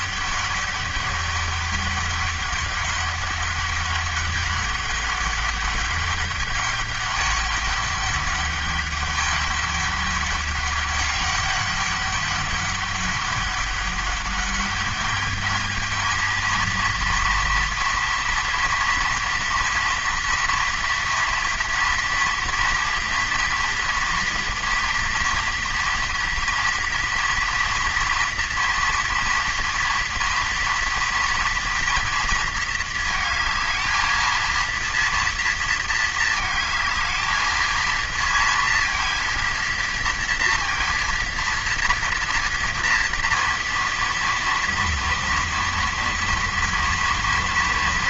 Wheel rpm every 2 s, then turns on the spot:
200, 200, 200, 200, 200, 200, 200, 200, 230, 230, 230, 230, 240, 230, 230, 230, 230, 230, 220, 230, 230, 230, 230, 230.
none